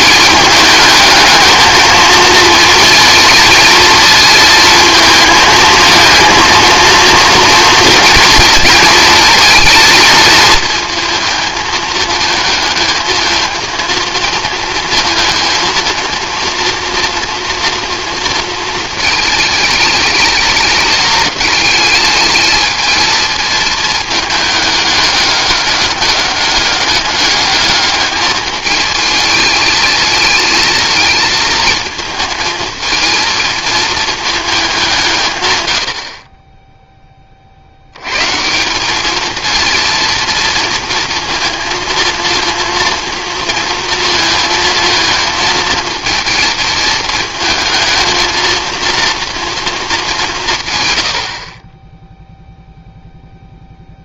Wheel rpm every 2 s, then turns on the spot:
220, 230, 220, 230, 230, 230, 220, 220, 230, 230, 210, 220, 210, 200, 210, 230, 220, 200, 10, 190, 230, 230, 220, 220, 230, 130, 0.
none